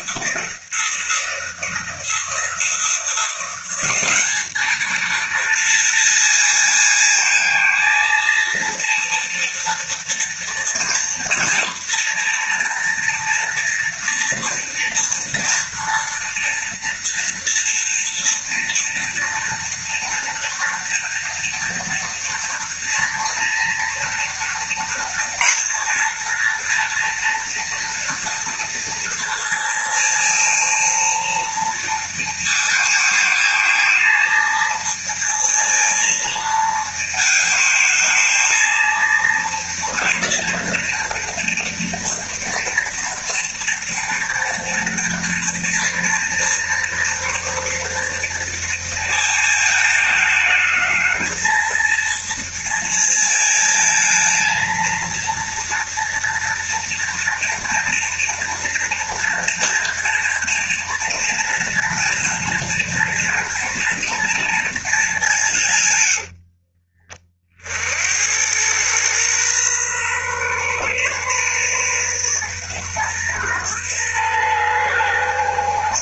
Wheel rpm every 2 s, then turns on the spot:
170, 170, 220, 230, 230, 230, 240, 230, 230, 230, 230, 230, 230, 230, 230, 230, 230, 230, 220, 230, 230, 230, 230, 230, 230, 220, 230, 230, 230, 230, 230, 230, 220, 50, 120, 130, 120, 120.
none